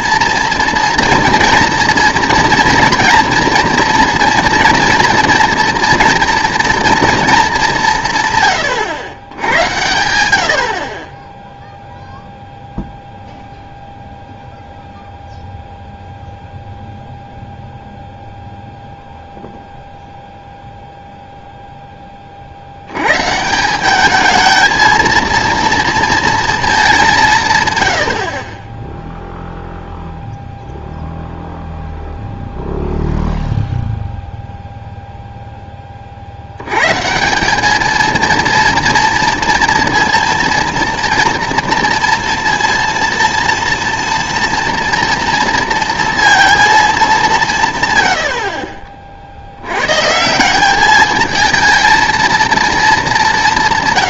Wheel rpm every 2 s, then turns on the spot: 230, 240, 230, 230, 130, 70, 0, 0, 0, 0, 0, 60, 220, 220, 30, 0, 0, 0, 90, 230, 230, 230, 230, 230, 50, 190, 230.
none